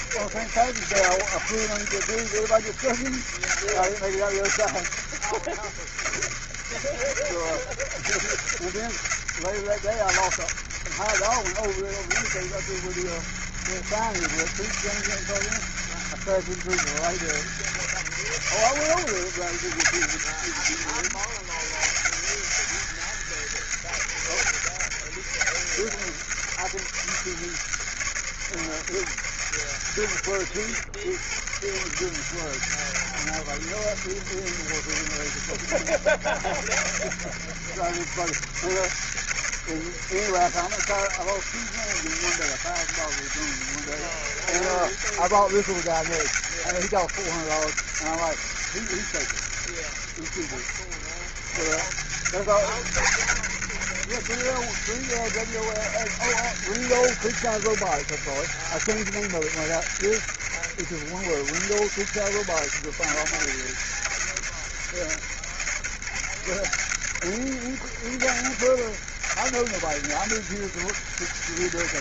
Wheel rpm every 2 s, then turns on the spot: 80, 80, 80, 70, 80, 80, 60, 90, 90, 80, 90, 100, 80, 80, 80, 60, 80, 80, 70, 70, 80, 100, 90, 90, 90, 70, 90, 90, 90, 80, 80, 90, 80, 70, 80, 90.
none